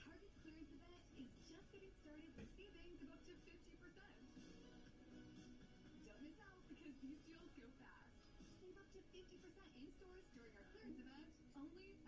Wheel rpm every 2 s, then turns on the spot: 0, 0, 0, 0, 0, 0.
none